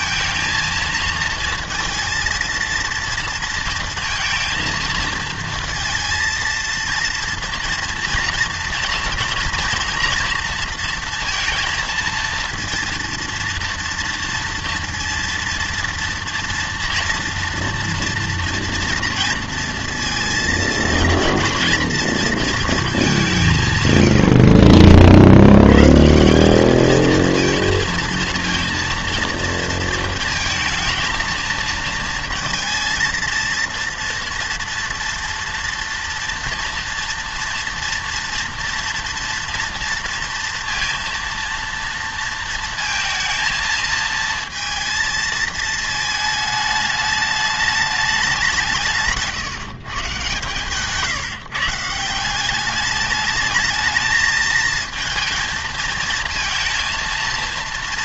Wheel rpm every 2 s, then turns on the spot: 220, 230, 230, 230, 230, 230, 230, 230, 240, 230, 230, 220, 50, 210, 230, 230, 230, 230, 230, 230, 230, 230, 230, 220, 170, 150, 200, 220, 230.
none